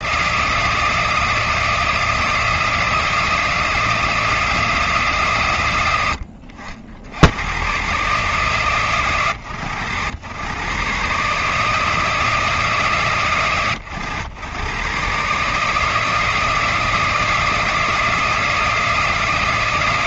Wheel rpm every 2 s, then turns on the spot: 160, 160, 140, 80, 120, 140, 130, 130, 160, 160.
none